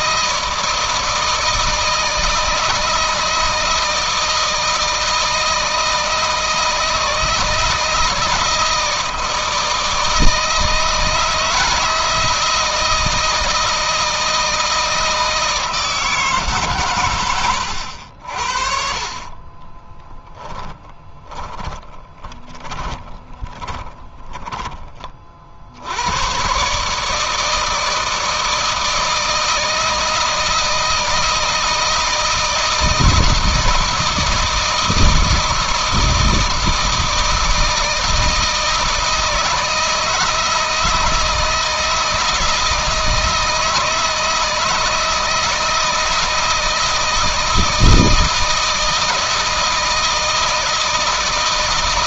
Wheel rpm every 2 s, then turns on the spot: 160, 160, 160, 160, 160, 160, 160, 160, 130, 50, 20, 20, 20, 140, 160, 160, 160, 160, 160, 160, 160, 160, 160, 160, 160, 160.
18-24